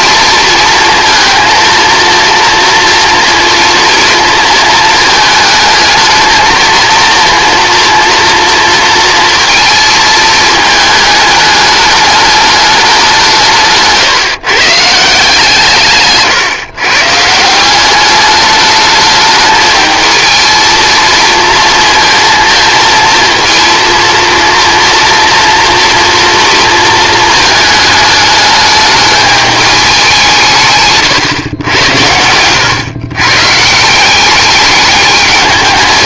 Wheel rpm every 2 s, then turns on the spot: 230, 230, 220, 220, 230, 210, 200, 150, 140, 210, 220, 230, 230, 230, 210, 150, 110, 200.
none